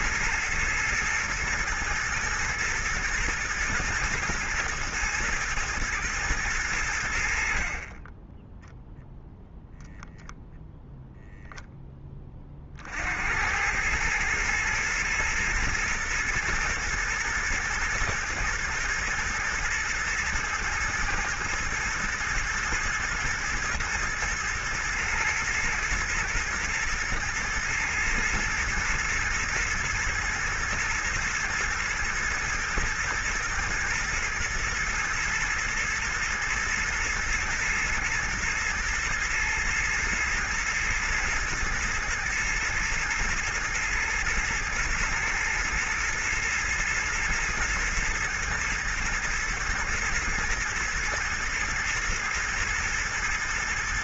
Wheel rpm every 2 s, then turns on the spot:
110, 120, 110, 80, 0, 0, 70, 110, 110, 110, 110, 120, 110, 120, 120, 120, 110, 120, 120, 110, 120, 110, 110, 110, 120, 120, 110.
none